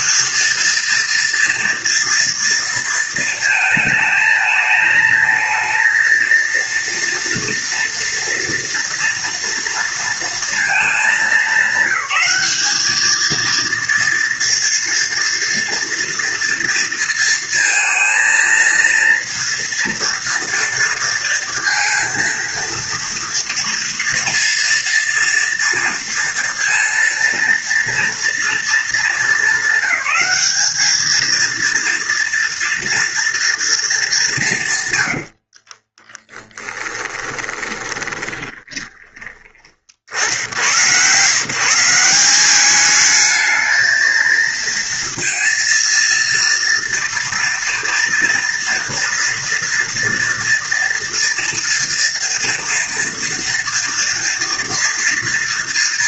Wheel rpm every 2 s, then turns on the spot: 230, 230, 220, 230, 230, 220, 220, 230, 230, 230, 230, 230, 230, 230, 220, 210, 230, 130, 20, 20, 100, 210, 230, 240, 240, 230, 230, 230.
34-40